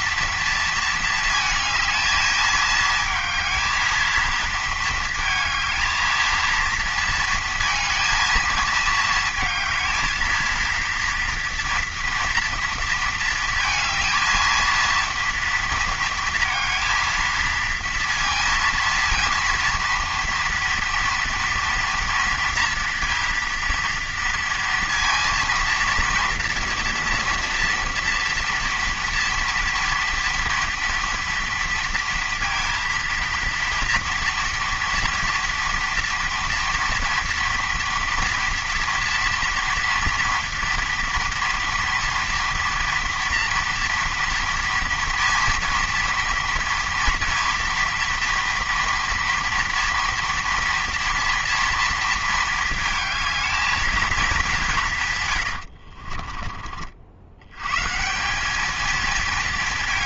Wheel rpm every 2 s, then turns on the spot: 230, 220, 230, 230, 220, 230, 230, 230, 230, 230, 230, 230, 230, 230, 230, 230, 230, 230, 240, 230, 230, 230, 230, 230, 240, 230, 220, 190, 40, 210.
none